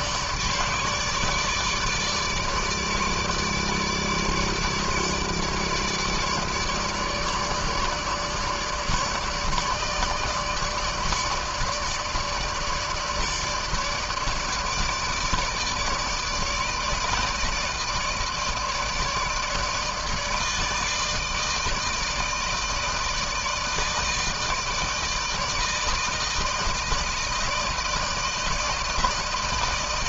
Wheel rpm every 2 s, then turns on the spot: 150, 150, 150, 150, 150, 160, 160, 150, 160, 160, 160, 160, 160, 160, 160.
none